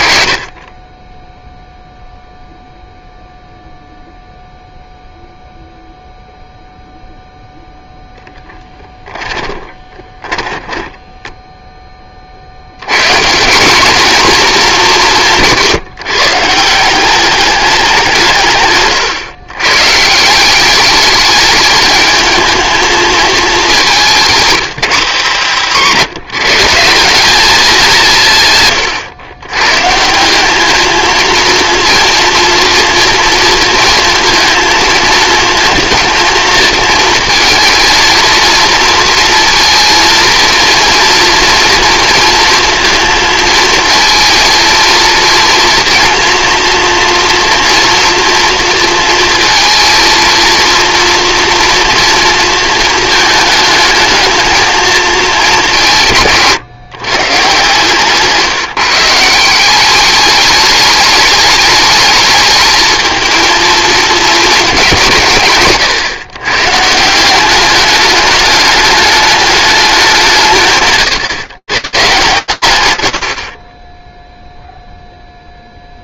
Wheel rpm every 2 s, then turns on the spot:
30, 0, 0, 0, 10, 10, 110, 230, 170, 140, 190, 220, 170, 170, 130, 210, 230, 230, 220, 230, 230, 230, 230, 230, 230, 230, 230, 220, 130, 160, 210, 220, 200, 140, 210, 140, 130, 0.
8-12 24-26